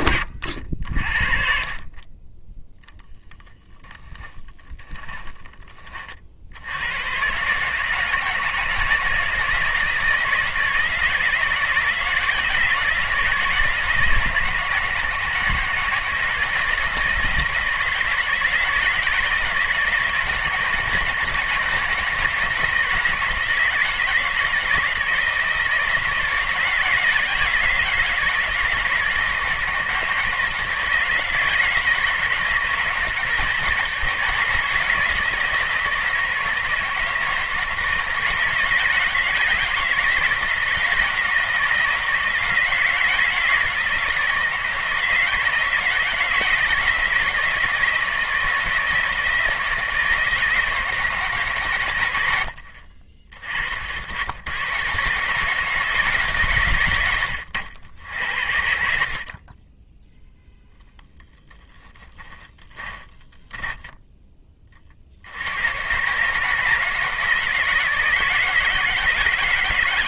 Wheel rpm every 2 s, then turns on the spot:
60, 10, 20, 100, 160, 160, 160, 160, 160, 160, 150, 160, 160, 160, 160, 160, 160, 160, 160, 170, 170, 160, 160, 160, 160, 160, 60, 120, 130, 50, 0, 20, 50, 160, 160.
2-6 62-64